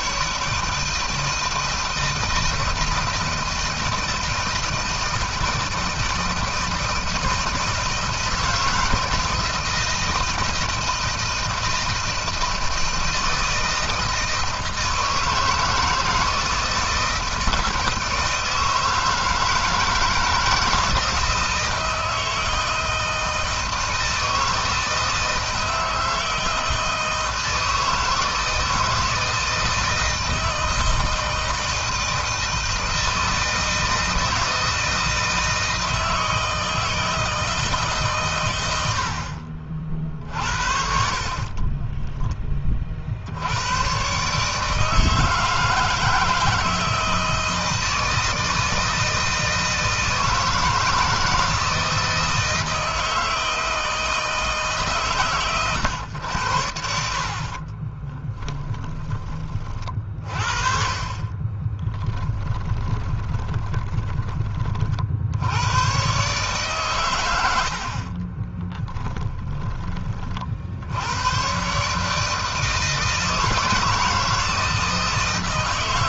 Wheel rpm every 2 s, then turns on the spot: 160, 160, 160, 160, 160, 160, 160, 160, 160, 160, 160, 160, 160, 160, 160, 160, 160, 160, 160, 90, 50, 50, 150, 160, 160, 160, 160, 150, 80, 30, 40, 20, 40, 130, 30, 70, 160, 160.
40-42 56-58 62-64 68-70